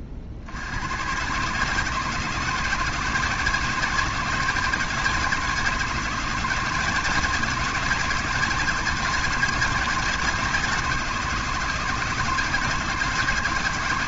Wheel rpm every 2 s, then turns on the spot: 80, 160, 160, 170, 170, 150, 160.
none